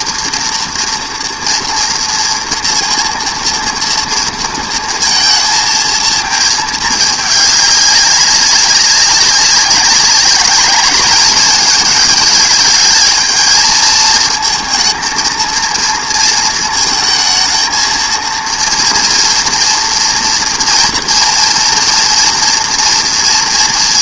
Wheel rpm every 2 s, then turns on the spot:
230, 230, 230, 220, 200, 200, 210, 230, 220, 230, 230, 230.
none